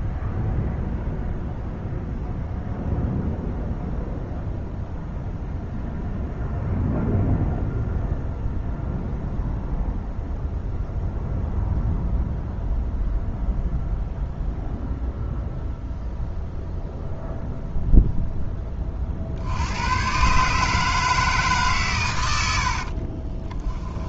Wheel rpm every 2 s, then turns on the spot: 0, 0, 0, 0, 0, 0, 0, 0, 0, 20, 150, 60.
22-24